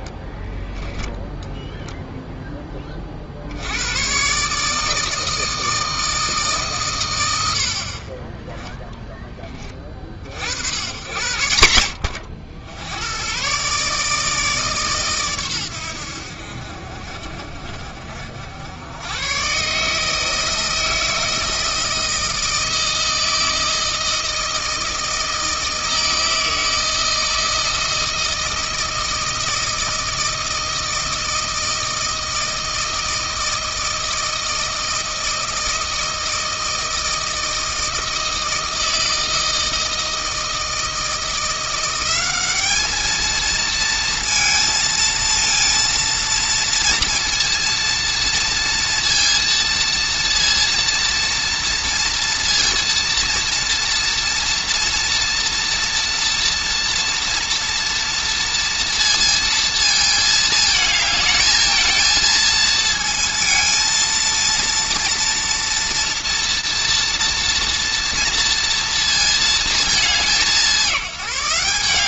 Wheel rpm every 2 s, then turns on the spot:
10, 10, 140, 150, 20, 60, 80, 150, 60, 70, 160, 160, 160, 160, 160, 160, 160, 160, 160, 160, 160, 200, 230, 230, 230, 230, 230, 230, 230, 230, 220, 220, 230, 230, 230, 200.
none